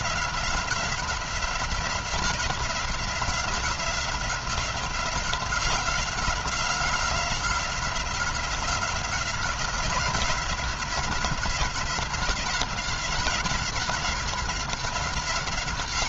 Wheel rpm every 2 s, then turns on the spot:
180, 180, 180, 180, 180, 180, 190, 190.
none